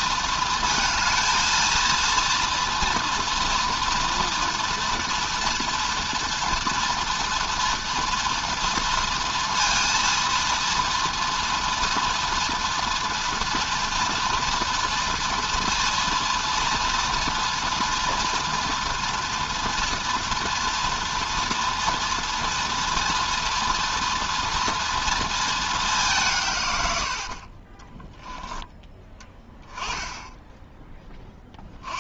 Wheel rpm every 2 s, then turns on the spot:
230, 240, 230, 230, 230, 230, 240, 230, 230, 240, 240, 230, 230, 130, 10, 10.
none